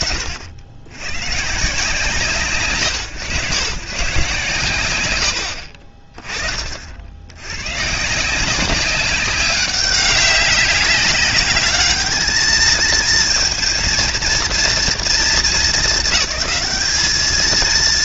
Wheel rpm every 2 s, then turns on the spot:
70, 90, 70, 60, 190, 190, 220, 230, 220.
none